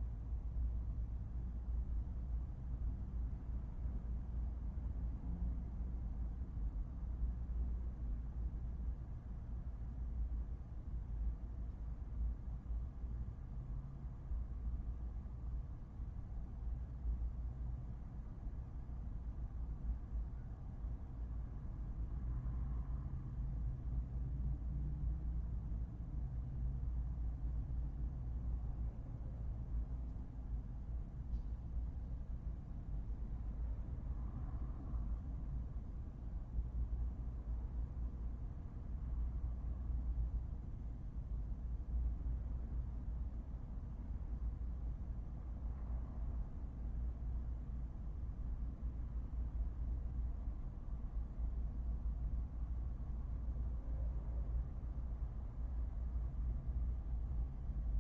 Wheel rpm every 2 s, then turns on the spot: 0, 0, 0, 0, 0, 0, 0, 0, 0, 0, 0, 0, 0, 0, 0, 0, 0, 0, 0, 0, 0, 0, 0, 0, 0, 0, 0, 0, 0.
none